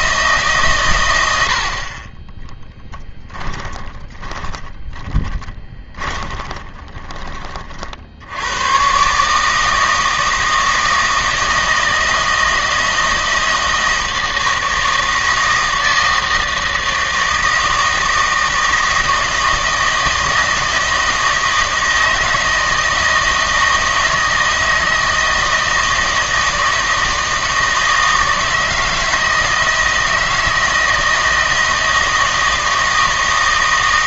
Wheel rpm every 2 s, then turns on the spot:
140, 10, 20, 20, 100, 160, 160, 160, 160, 160, 160, 160, 160, 160, 160, 160, 160.
2-8